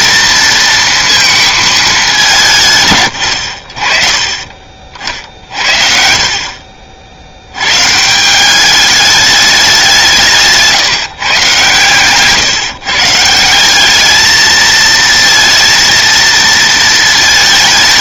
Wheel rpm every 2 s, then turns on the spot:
230, 110, 50, 50, 200, 160, 140, 220, 220.
none